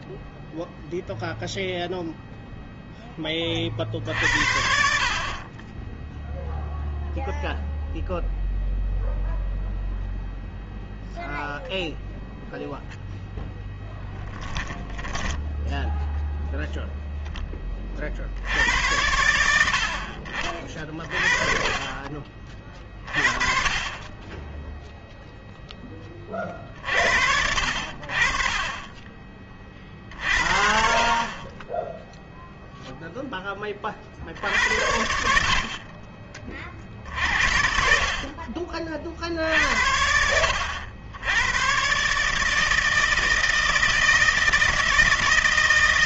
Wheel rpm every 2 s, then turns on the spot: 0, 0, 50, 0, 0, 0, 0, 10, 0, 60, 40, 30, 20, 30, 40, 50, 0, 60, 30, 50, 70, 150, 160.
14-16